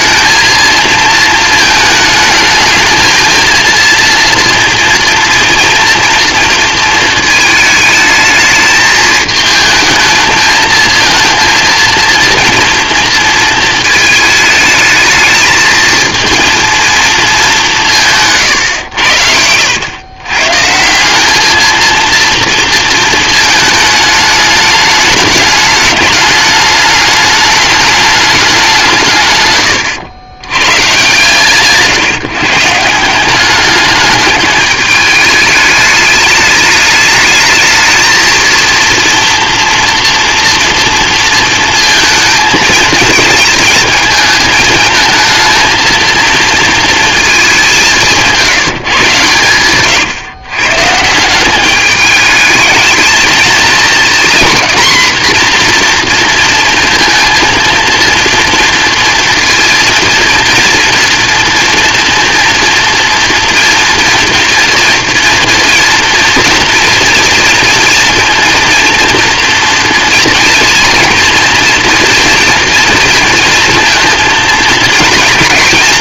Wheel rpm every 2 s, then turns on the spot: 220, 220, 230, 230, 220, 220, 230, 220, 230, 110, 150, 230, 210, 210, 180, 110, 150, 210, 210, 230, 230, 220, 220, 230, 170, 120, 210, 240, 230, 230, 230, 230, 230, 230, 240, 230, 230, 230.
18-20